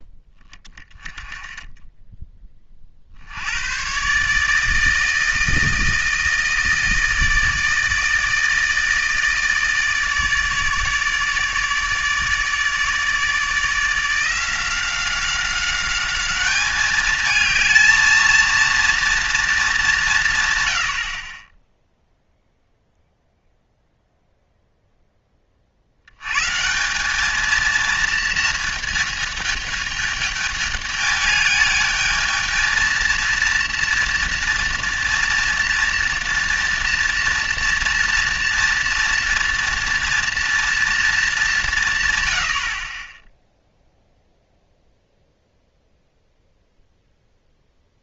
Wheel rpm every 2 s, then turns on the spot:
10, 40, 160, 160, 160, 150, 150, 180, 210, 230, 110, 0, 0, 180, 220, 210, 220, 230, 230, 230, 230, 50, 0, 0.
none